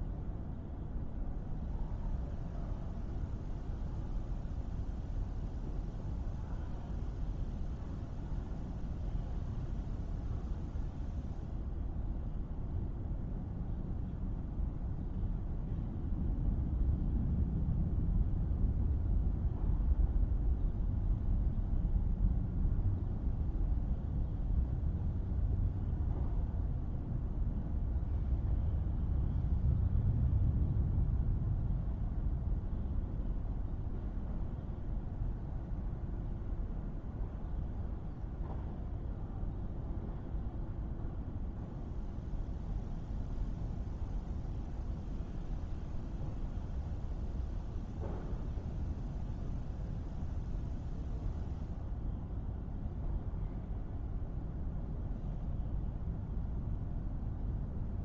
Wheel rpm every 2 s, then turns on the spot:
0, 0, 0, 0, 0, 0, 0, 0, 0, 0, 0, 0, 0, 0, 0, 0, 0, 0, 0, 0, 0, 0, 0, 0, 0, 0, 0, 0, 0.
none